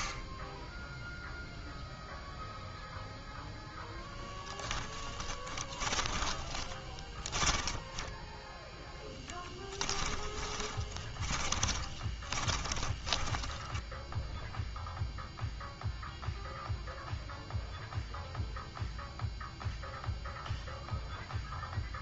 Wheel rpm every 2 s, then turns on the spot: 0, 0, 10, 20, 10, 20, 20, 0, 0, 0, 0.
4-14